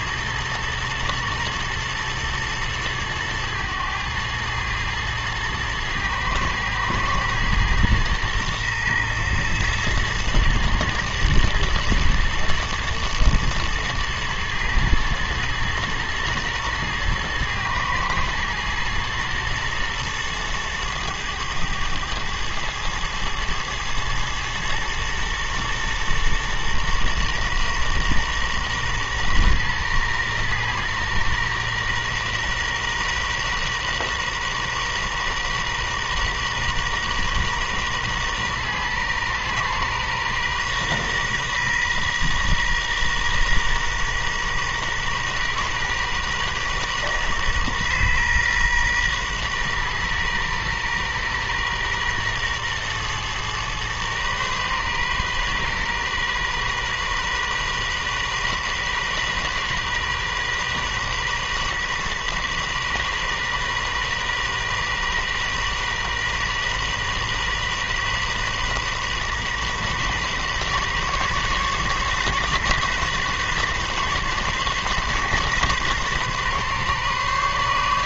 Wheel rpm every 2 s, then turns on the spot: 120, 110, 110, 110, 120, 120, 110, 120, 120, 110, 110, 110, 110, 120, 120, 120, 120, 120, 120, 120, 120, 120, 120, 130, 120, 120, 120, 120, 130, 130, 130, 130, 130, 130, 130, 130, 140, 130, 130.
none